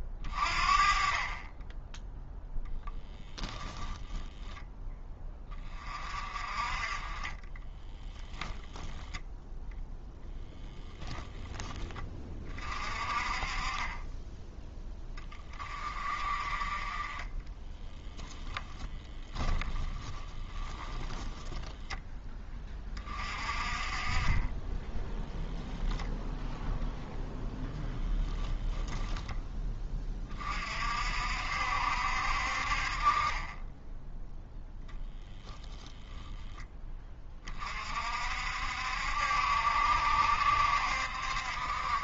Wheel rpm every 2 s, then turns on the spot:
40, 0, 10, 30, 10, 10, 40, 20, 30, 10, 10, 30, 10, 0, 10, 50, 40, 0, 20, 60, 60.
18-20 24-26